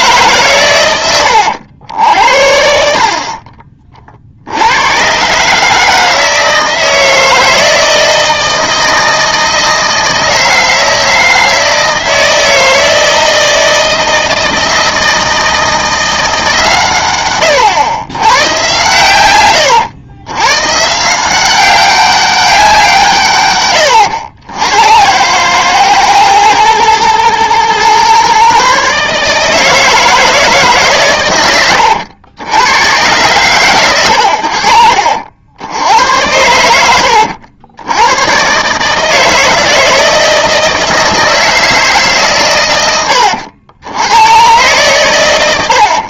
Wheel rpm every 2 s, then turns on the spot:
110, 50, 90, 160, 160, 160, 160, 160, 140, 120, 130, 180, 90, 120, 140, 150, 100, 70, 90, 140, 160, 110, 120.
none